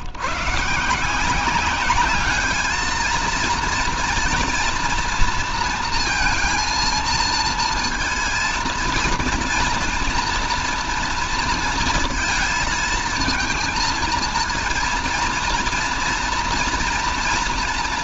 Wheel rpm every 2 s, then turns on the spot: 150, 220, 230, 230, 230, 230, 230, 230, 230.
none